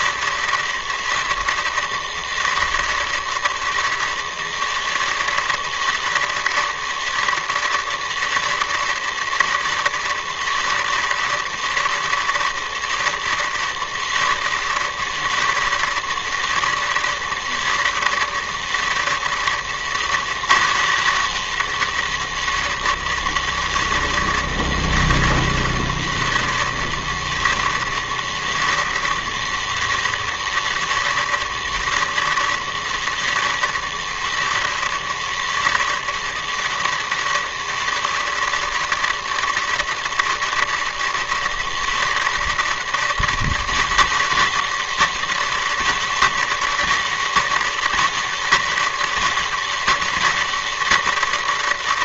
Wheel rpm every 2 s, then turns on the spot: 160, 160, 160, 160, 160, 160, 160, 160, 160, 170, 190, 160, 160, 160, 160, 160, 160, 160, 160, 160, 160, 160, 160, 160, 160, 160.
none